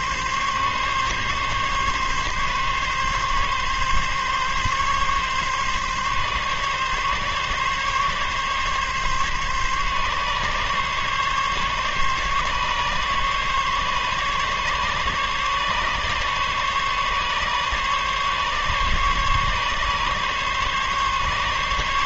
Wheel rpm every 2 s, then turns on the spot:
140, 140, 140, 140, 140, 140, 140, 140, 140, 140, 140.
none